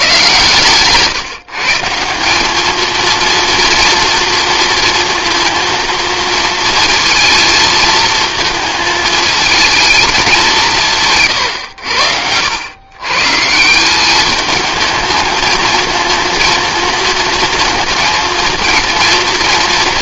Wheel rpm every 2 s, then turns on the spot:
150, 210, 230, 230, 220, 170, 100, 210, 230, 230.
none